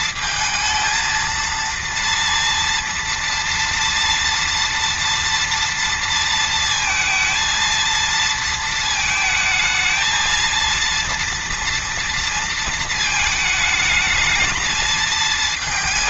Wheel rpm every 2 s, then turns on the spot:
230, 230, 230, 230, 220, 230, 230, 220.
none